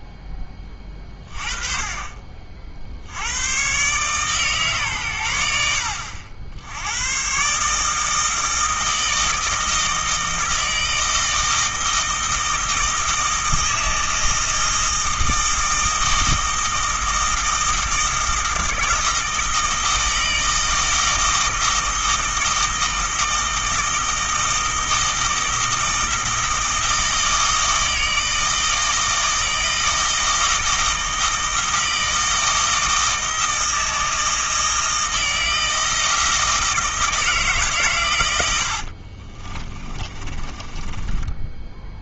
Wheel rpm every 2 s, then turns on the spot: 20, 50, 130, 90, 160, 160, 160, 160, 160, 160, 160, 160, 160, 160, 160, 160, 160, 160, 160, 80, 30.
38-42